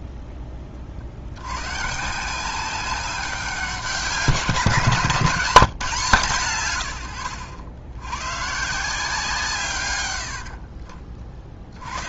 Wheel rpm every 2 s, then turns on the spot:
40, 190, 170, 100, 160, 40.
10-12